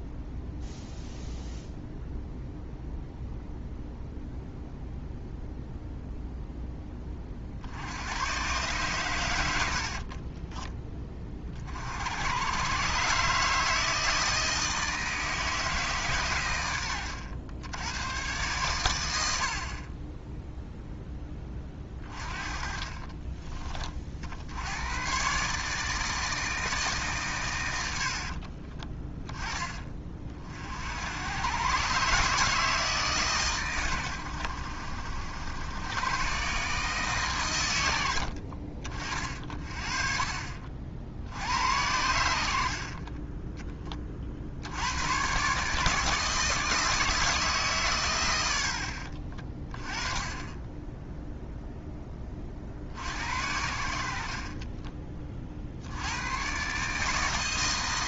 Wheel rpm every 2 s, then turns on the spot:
0, 0, 0, 0, 120, 20, 120, 160, 100, 110, 0, 30, 90, 160, 40, 50, 150, 70, 140, 50, 50, 60, 70, 160, 80, 10, 50, 30, 130.
10-12 22-24 28-30 54-56